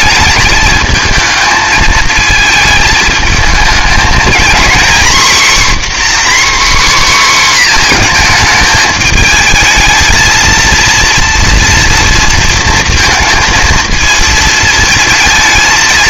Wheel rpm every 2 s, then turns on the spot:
220, 220, 250, 270, 220, 230, 230, 220.
none